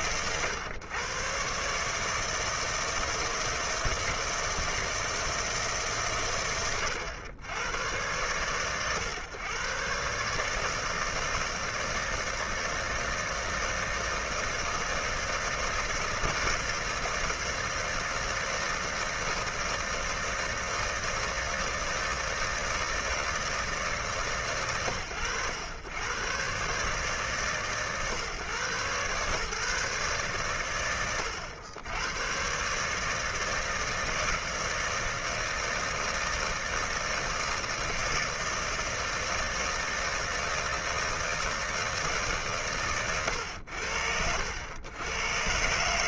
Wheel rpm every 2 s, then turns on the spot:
120, 160, 160, 120, 120, 160, 160, 160, 160, 160, 160, 160, 110, 140, 130, 100, 140, 160, 160, 160, 160, 120, 110.
42-44